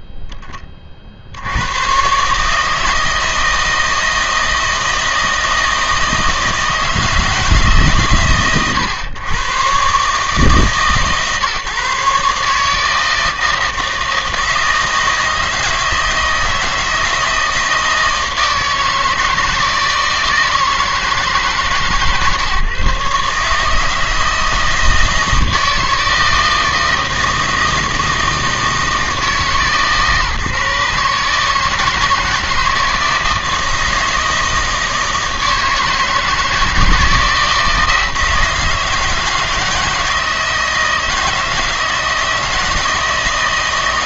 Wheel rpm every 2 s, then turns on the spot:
10, 150, 160, 160, 120, 150, 150, 160, 160, 160, 160, 150, 160, 160, 160, 150, 160, 160, 160, 160, 160, 160.
none